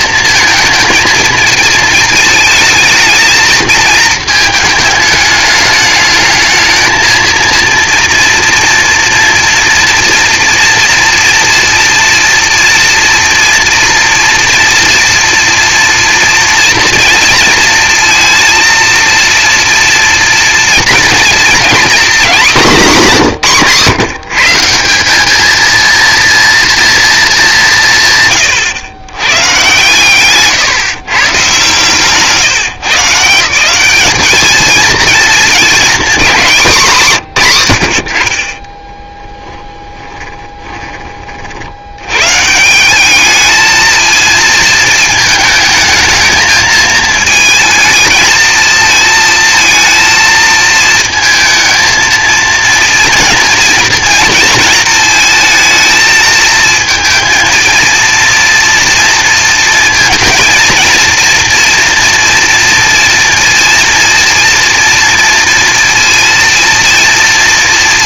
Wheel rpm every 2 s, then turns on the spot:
230, 220, 210, 220, 240, 230, 230, 230, 230, 230, 230, 230, 180, 230, 120, 130, 140, 220, 210, 40, 20, 170, 220, 220, 230, 230, 220, 220, 220, 230, 230, 230, 230, 230.
38-42